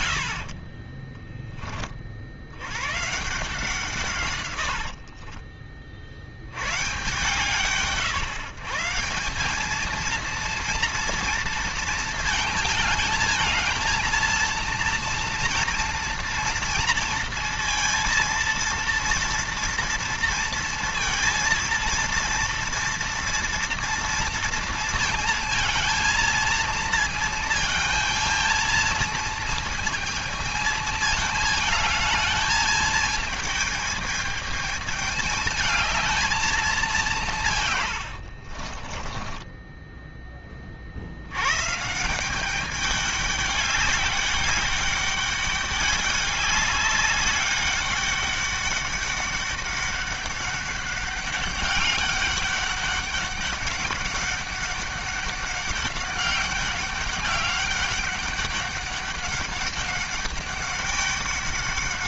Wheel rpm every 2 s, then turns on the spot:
50, 90, 90, 100, 150, 230, 220, 230, 230, 230, 230, 230, 230, 230, 230, 220, 220, 210, 210, 50, 30, 200, 200, 200, 200, 200, 200, 200, 200, 200, 200.
0-2 4-6 38-40